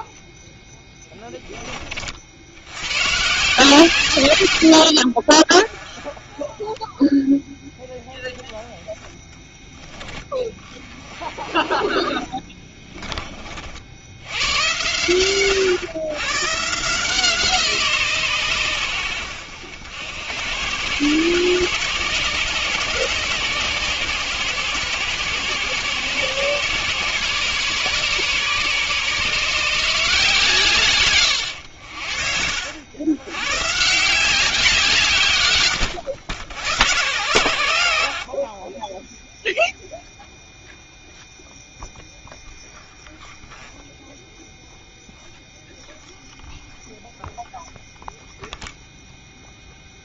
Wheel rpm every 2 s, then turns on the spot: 10, 110, 60, 10, 30, 30, 20, 110, 160, 100, 110, 130, 120, 130, 140, 130, 90, 160, 100, 20, 0, 0, 0, 0, 0.
12-14 30-32